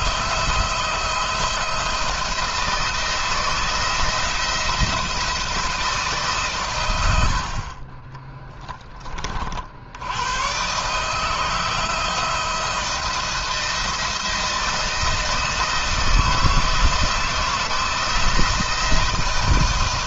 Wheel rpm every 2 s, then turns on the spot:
170, 170, 170, 110, 20, 150, 170, 170, 160, 160.
none